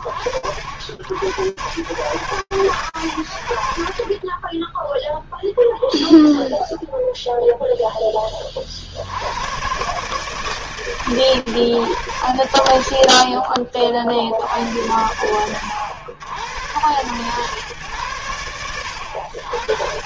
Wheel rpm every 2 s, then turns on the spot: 70, 110, 0, 0, 50, 140, 60, 80, 100, 80.
none